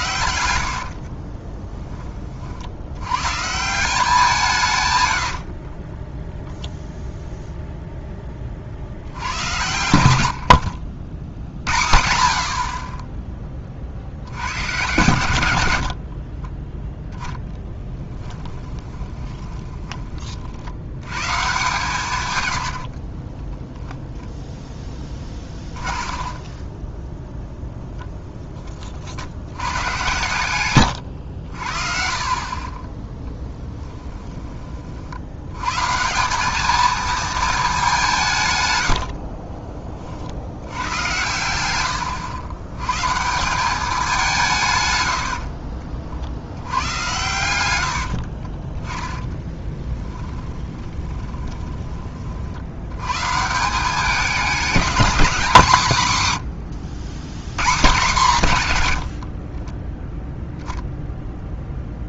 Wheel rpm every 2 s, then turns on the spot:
60, 60, 150, 0, 40, 80, 60, 110, 20, 10, 60, 100, 0, 20, 10, 110, 30, 20, 200, 140, 80, 110, 160, 80, 30, 10, 70, 210, 120, 140, 0.
10-12 16-20 26-28 30-32 48-52